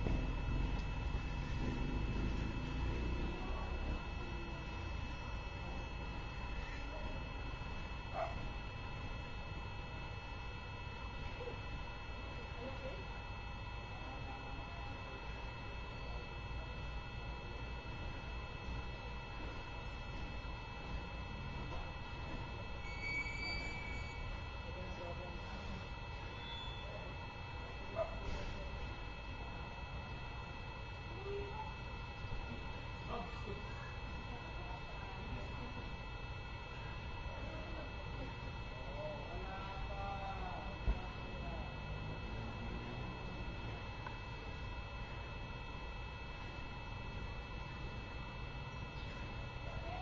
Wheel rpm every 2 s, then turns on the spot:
0, 0, 0, 0, 0, 0, 0, 0, 0, 0, 0, 0, 0, 0, 0, 0, 0, 0, 0, 0, 0, 0, 0, 0, 0.
none